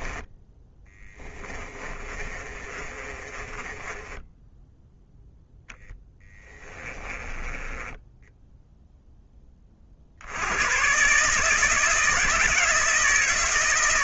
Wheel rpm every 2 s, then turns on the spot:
20, 30, 10, 20, 10, 140, 160.
0-4 6-8